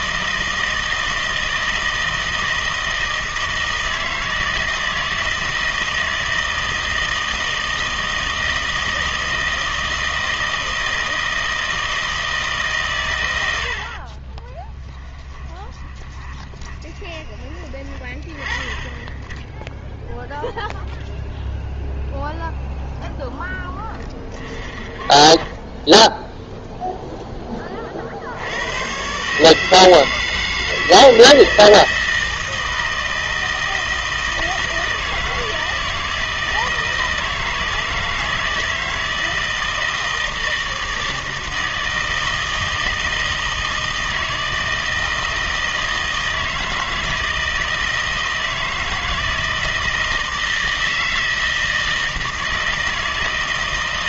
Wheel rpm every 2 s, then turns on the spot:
160, 160, 160, 160, 160, 160, 140, 20, 20, 10, 0, 0, 0, 0, 100, 160, 160, 160, 160, 160, 160, 160, 160, 160, 160, 160, 160.
14-18